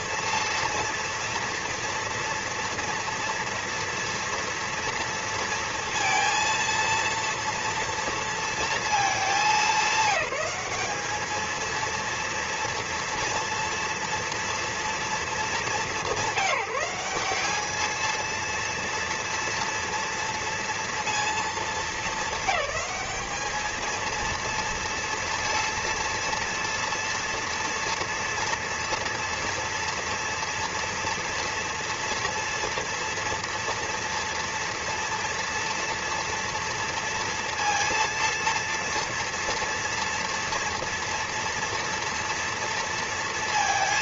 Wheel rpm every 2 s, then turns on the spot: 230, 230, 230, 230, 230, 200, 230, 230, 180, 230, 230, 210, 230, 230, 230, 230, 230, 230, 230, 230, 230, 230.
none